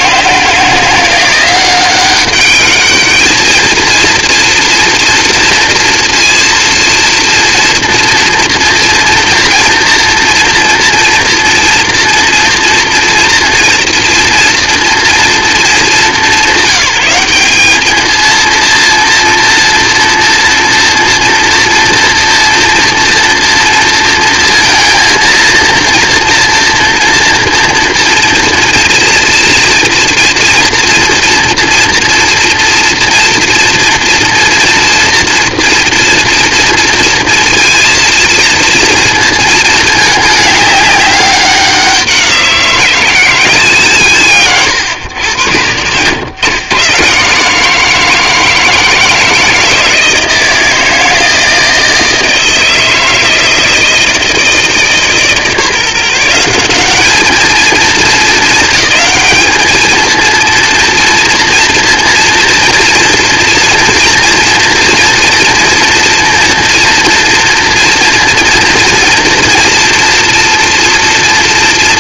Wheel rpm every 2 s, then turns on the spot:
160, 200, 230, 230, 230, 230, 240, 230, 190, 230, 230, 230, 230, 230, 240, 230, 230, 230, 230, 230, 210, 180, 150, 110, 160, 160, 160, 160, 170, 220, 230, 230, 230, 230, 240, 240.
none